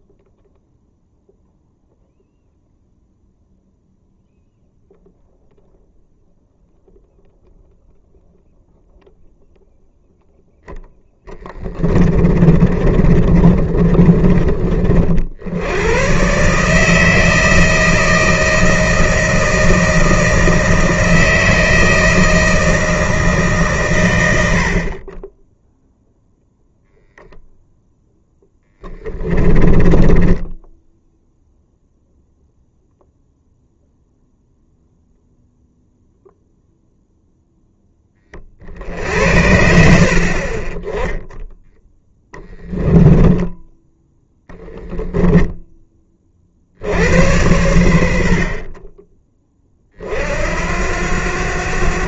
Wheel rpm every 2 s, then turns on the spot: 0, 0, 0, 0, 0, 10, 30, 50, 160, 160, 160, 160, 30, 0, 20, 0, 0, 0, 0, 60, 10, 10, 0, 80, 20, 70.
10-14 28-30 42-44